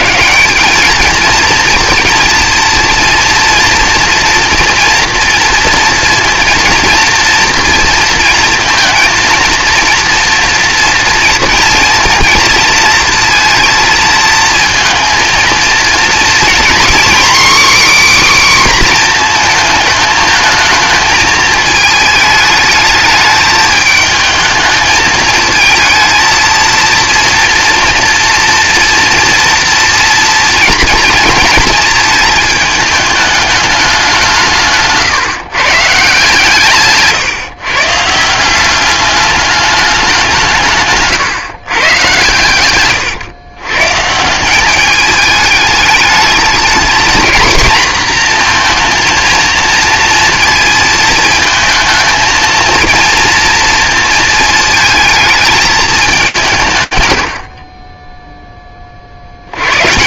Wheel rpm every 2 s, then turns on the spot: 200, 230, 230, 230, 230, 230, 230, 230, 250, 270, 220, 220, 220, 230, 230, 230, 220, 150, 140, 190, 150, 120, 190, 210, 230, 230, 230, 220, 130, 30.
42-44